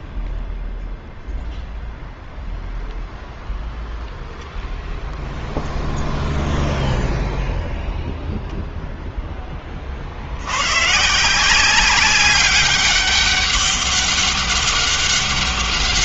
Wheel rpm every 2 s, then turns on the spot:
0, 0, 0, 0, 0, 80, 200, 200.
none